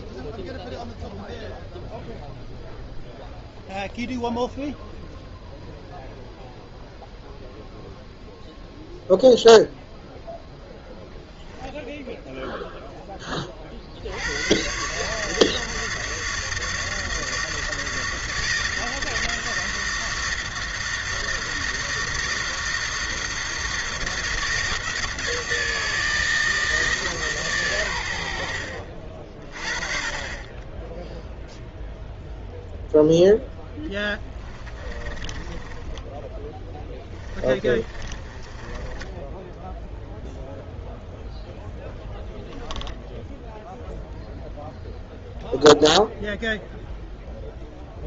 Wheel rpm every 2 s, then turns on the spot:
0, 0, 0, 0, 0, 0, 10, 150, 160, 160, 160, 160, 160, 160, 40, 0, 0, 20, 10, 20, 0, 0, 0, 0.
34-40